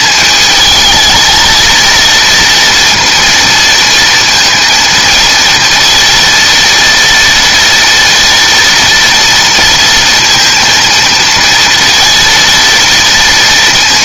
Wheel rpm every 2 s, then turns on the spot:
200, 230, 230, 230, 230, 230, 230.
none